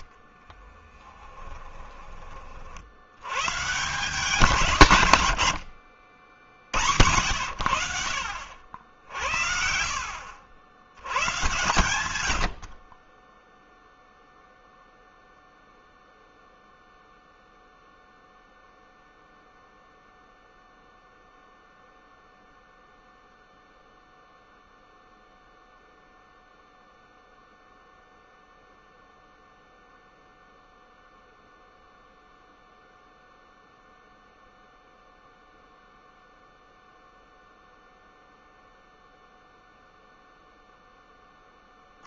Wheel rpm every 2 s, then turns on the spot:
20, 60, 150, 90, 70, 80, 40, 0, 0, 0, 0, 0, 0, 0, 0, 0, 0, 0, 0, 0, 10.
0-2